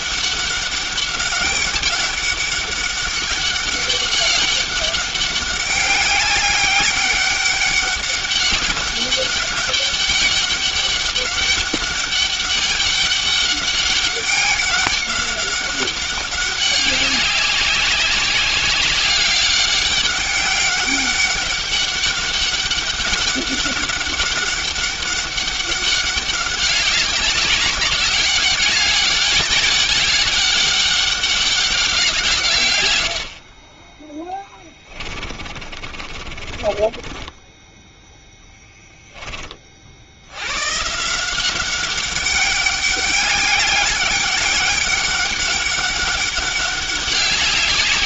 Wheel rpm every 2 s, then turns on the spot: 200, 200, 200, 200, 200, 200, 200, 200, 200, 190, 200, 200, 200, 190, 200, 200, 100, 30, 20, 10, 150, 200, 190, 200.
32-38